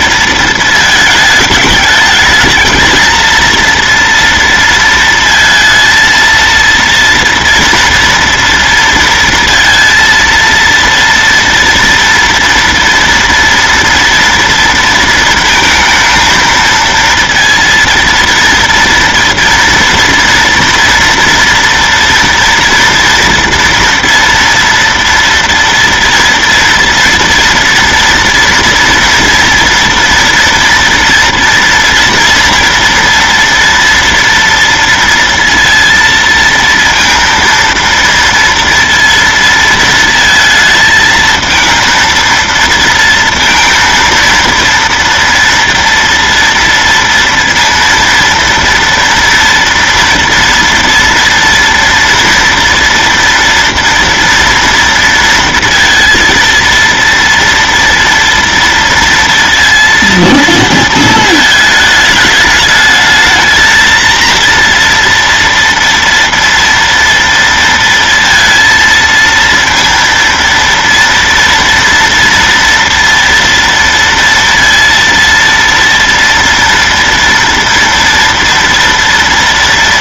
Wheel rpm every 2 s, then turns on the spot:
220, 220, 230, 230, 230, 230, 230, 230, 220, 230, 230, 230, 230, 230, 230, 240, 230, 230, 230, 230, 220, 230, 230, 230, 230, 230, 230, 230, 230, 230, 230, 210, 230, 230, 230, 230, 230, 230, 230, 230.
none